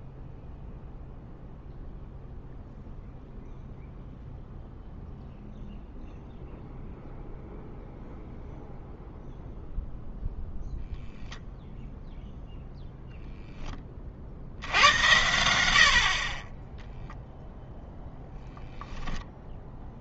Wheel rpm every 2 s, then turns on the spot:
0, 0, 0, 0, 0, 0, 0, 80, 0, 0.
none